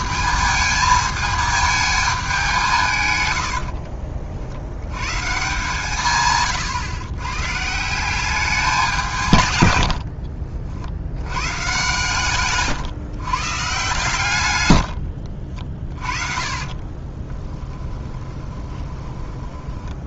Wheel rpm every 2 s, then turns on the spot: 220, 170, 90, 120, 190, 60, 130, 110, 30, 20.
14-20